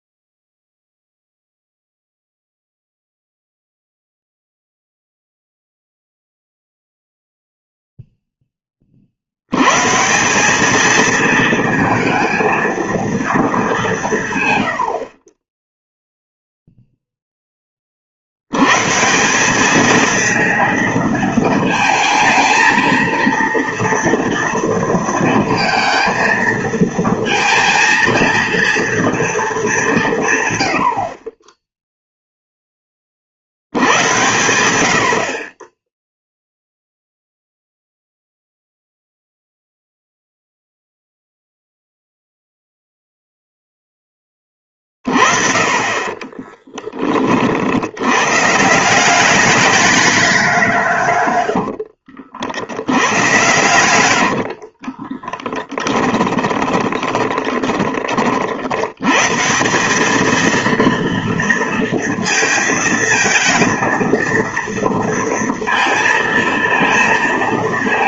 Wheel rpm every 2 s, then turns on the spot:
0, 0, 0, 0, 0, 140, 230, 180, 0, 40, 220, 220, 230, 220, 230, 170, 0, 90, 10, 0, 0, 0, 10, 30, 100, 210, 70, 90, 10, 30, 200, 230, 230, 230.
52-58